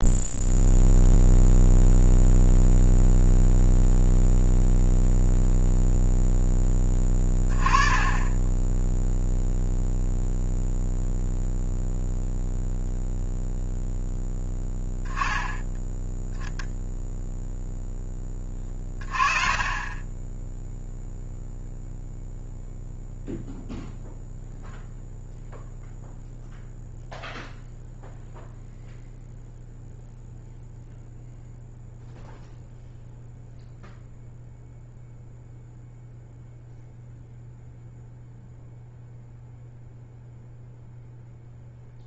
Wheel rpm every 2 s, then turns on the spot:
0, 0, 0, 20, 10, 0, 0, 10, 0, 40, 0, 0, 0, 0, 0, 0, 0, 0, 0, 0, 0.
none